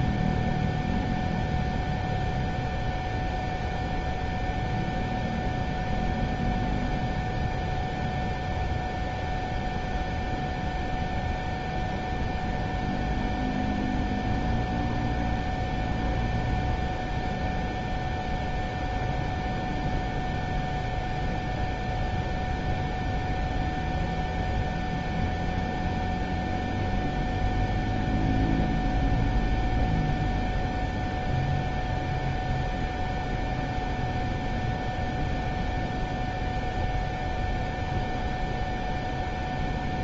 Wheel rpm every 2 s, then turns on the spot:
0, 0, 0, 0, 0, 0, 0, 0, 0, 0, 0, 0, 0, 0, 0, 0, 0, 0, 0, 0.
none